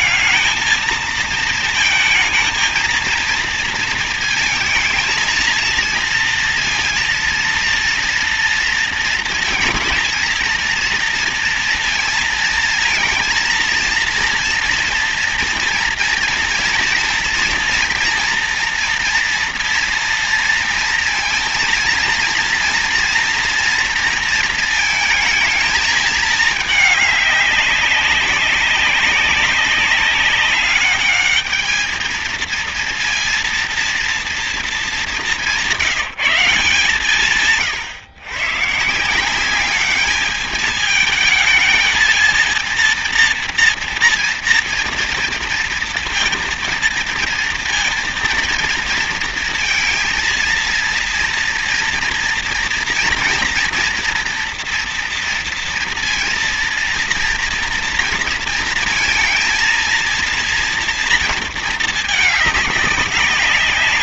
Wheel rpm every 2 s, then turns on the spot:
220, 230, 220, 230, 230, 230, 230, 230, 230, 240, 230, 240, 230, 210, 190, 200, 230, 210, 160, 160, 220, 230, 230, 230, 230, 230, 230, 230, 230, 230, 230, 200.
none